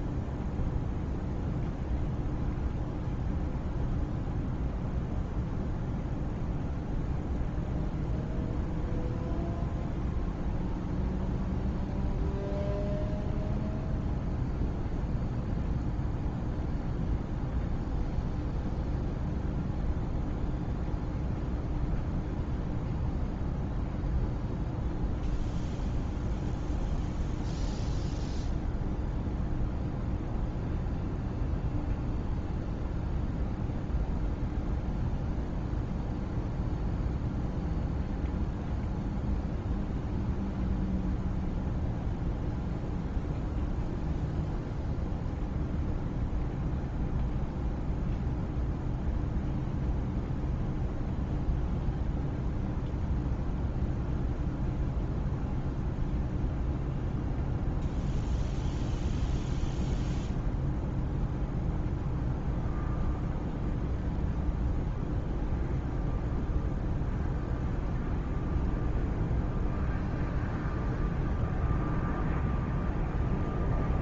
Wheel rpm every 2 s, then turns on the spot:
0, 0, 0, 0, 0, 0, 0, 0, 0, 0, 0, 0, 0, 0, 0, 0, 0, 0, 0, 0, 0, 0, 0, 0, 0, 0, 0, 0, 0, 0, 0, 0, 0, 0, 0, 0, 0.
none